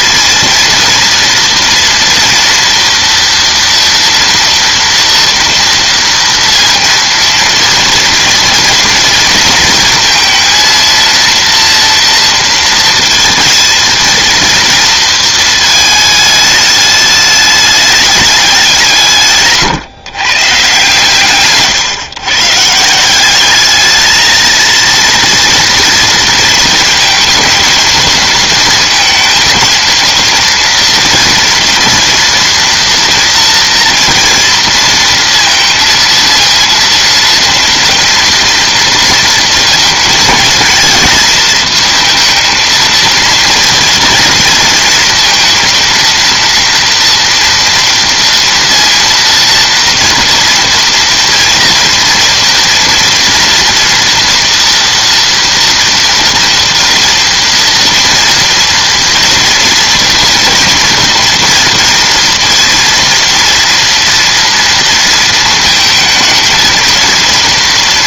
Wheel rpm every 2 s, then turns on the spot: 230, 230, 230, 230, 230, 230, 230, 230, 210, 180, 130, 150, 220, 230, 230, 230, 240, 230, 230, 230, 220, 230, 230, 230, 230, 230, 230, 230, 230, 230, 230, 230, 230, 230.
none